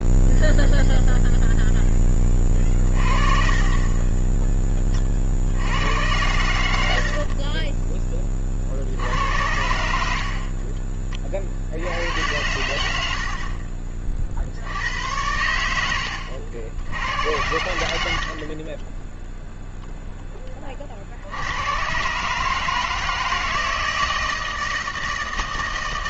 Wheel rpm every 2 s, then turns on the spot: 0, 20, 30, 90, 40, 40, 90, 80, 80, 20, 40, 160, 160.
10-12 18-20